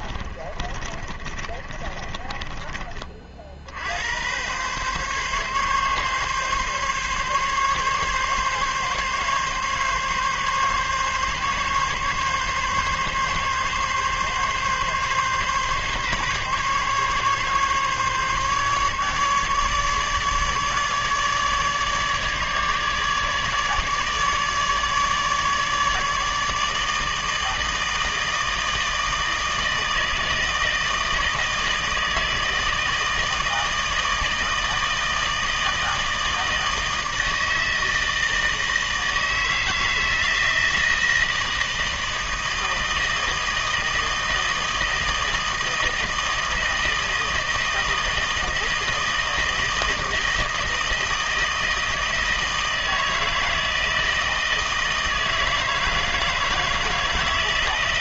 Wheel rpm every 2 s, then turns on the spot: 30, 20, 120, 140, 140, 140, 140, 140, 140, 150, 150, 150, 150, 160, 160, 160, 160, 160, 160, 160, 160, 160, 160, 160, 160, 160, 160, 160, 160.
0-4